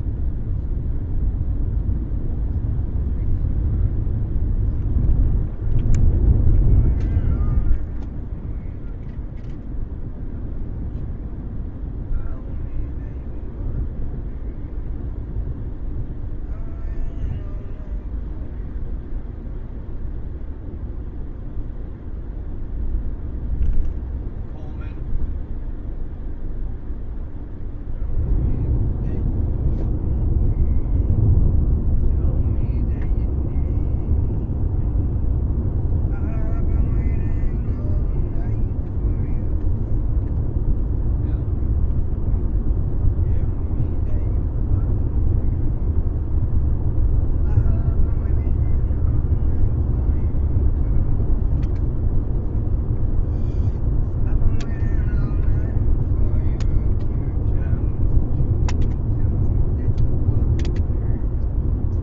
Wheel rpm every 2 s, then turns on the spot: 0, 0, 0, 0, 0, 0, 0, 0, 0, 0, 0, 0, 0, 0, 0, 0, 0, 0, 0, 0, 0, 0, 0, 0, 0, 0, 0, 0, 0, 0, 0.
none